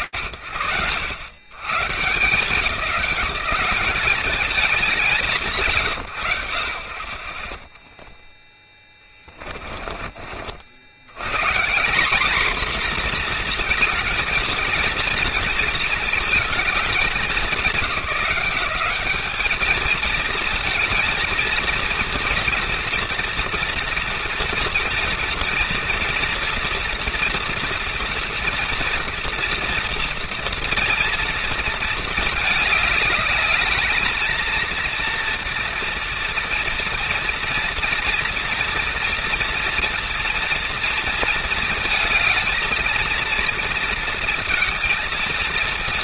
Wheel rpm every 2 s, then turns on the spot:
130, 200, 150, 50, 30, 140, 240, 230, 190, 210, 230, 240, 230, 230, 230, 230, 210, 230, 230, 230, 230, 230, 230.
8-10